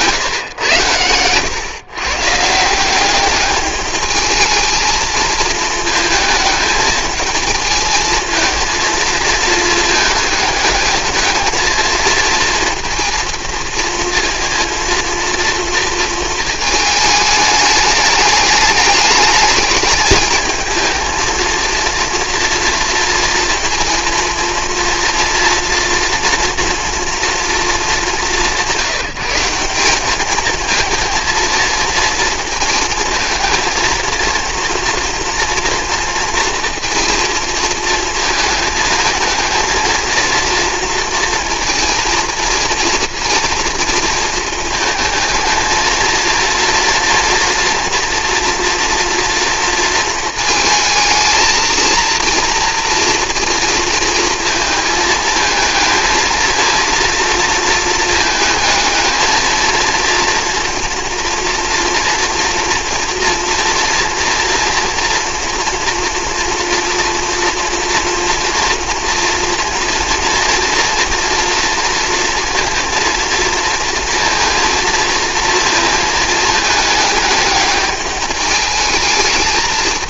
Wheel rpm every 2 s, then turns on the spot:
120, 160, 220, 220, 230, 220, 230, 230, 220, 210, 220, 230, 230, 230, 190, 220, 230, 230, 230, 220, 230, 230, 220, 230, 230, 220, 230, 220, 230, 220, 230, 230, 240, 230, 240, 240, 230, 230, 220, 210.
none